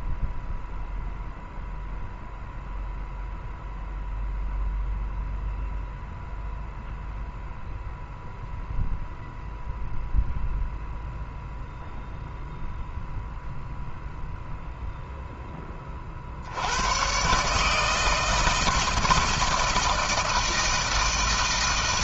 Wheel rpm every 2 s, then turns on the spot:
0, 0, 0, 0, 0, 0, 0, 0, 110, 160, 160.
none